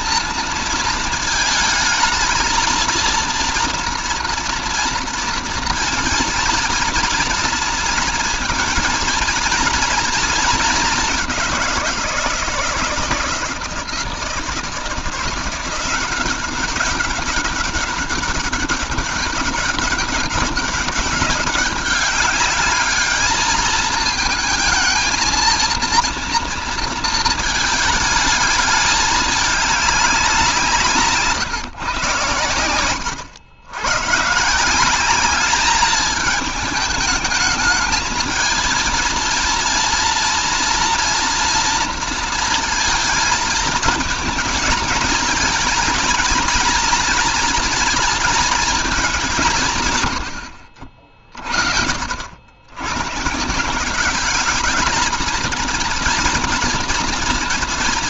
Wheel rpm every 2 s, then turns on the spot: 230, 230, 240, 240, 230, 220, 160, 160, 200, 200, 190, 210, 220, 230, 210, 180, 100, 170, 210, 230, 240, 230, 220, 240, 220, 60, 90, 210, 230.
50-52